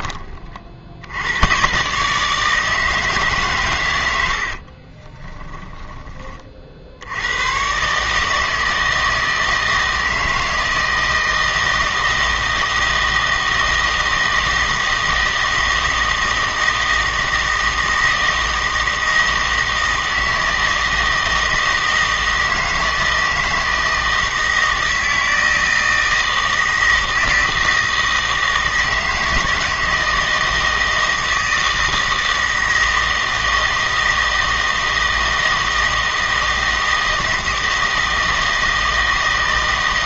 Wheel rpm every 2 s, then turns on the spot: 50, 160, 60, 50, 160, 160, 160, 160, 160, 160, 160, 160, 160, 160, 160, 160, 160, 160, 160, 160.
4-6